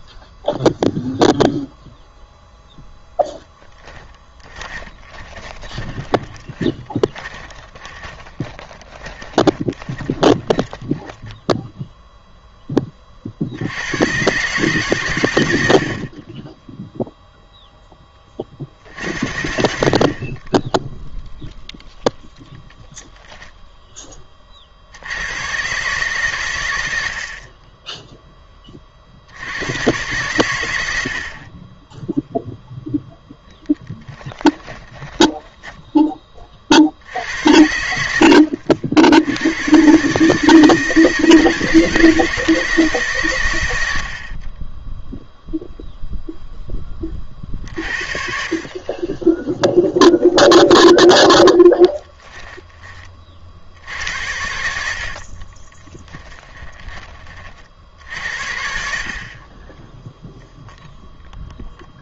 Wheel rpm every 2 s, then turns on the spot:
0, 0, 20, 30, 30, 20, 30, 140, 10, 50, 10, 0, 70, 80, 40, 90, 0, 10, 70, 60, 160, 160, 20, 20, 40, 10, 20, 70, 20, 60, 0.
4-12 34-36 54-56